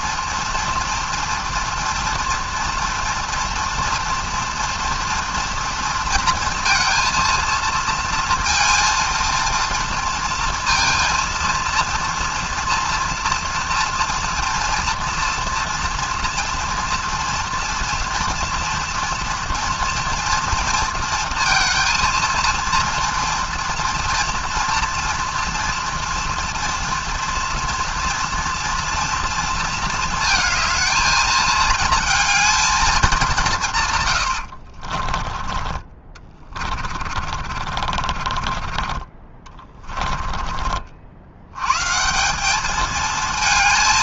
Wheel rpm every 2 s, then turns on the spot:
230, 230, 240, 230, 230, 230, 230, 230, 230, 230, 230, 230, 240, 230, 230, 220, 220, 60, 30, 30, 50, 210.
34-38